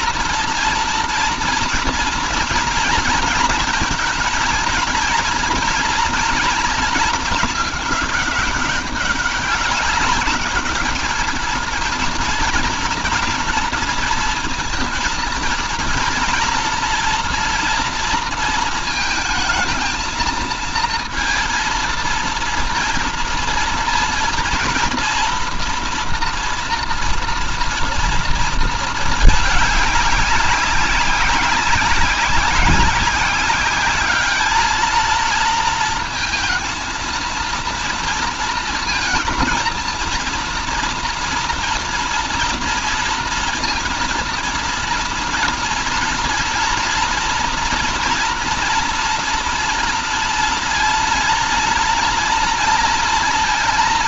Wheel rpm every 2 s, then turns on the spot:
230, 220, 230, 220, 190, 210, 230, 220, 230, 230, 230, 230, 230, 230, 220, 190, 190, 220, 230, 230, 240, 230, 230, 230, 230, 230, 230.
none